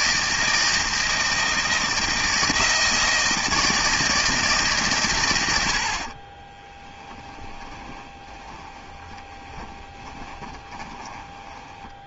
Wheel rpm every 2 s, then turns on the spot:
160, 160, 140, 10, 20, 20.
6-12